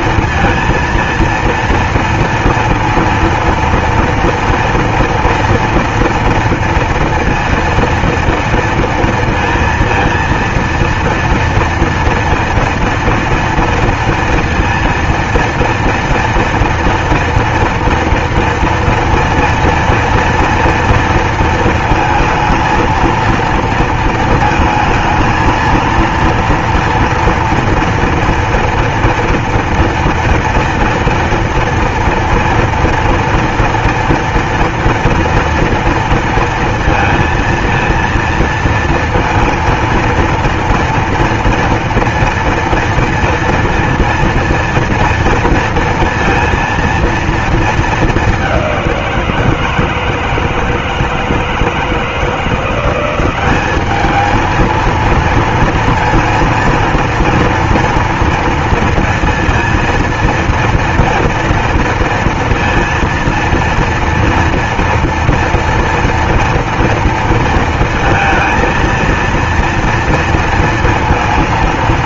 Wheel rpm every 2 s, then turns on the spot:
230, 230, 230, 230, 230, 230, 230, 230, 230, 230, 230, 220, 230, 230, 240, 230, 230, 230, 230, 230, 230, 230, 230, 230, 210, 160, 170, 220, 230, 230, 230, 230, 230, 240, 230, 230.
none